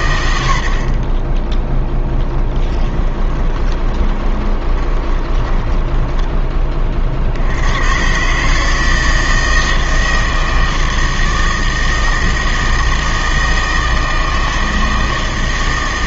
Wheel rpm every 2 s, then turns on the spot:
60, 10, 20, 30, 160, 160, 160, 160.
2-6